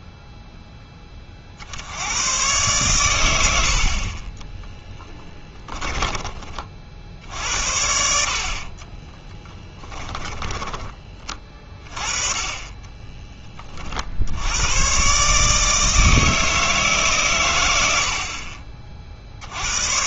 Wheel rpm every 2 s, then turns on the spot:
0, 120, 10, 40, 50, 10, 20, 90, 160, 40.
4-6 8-12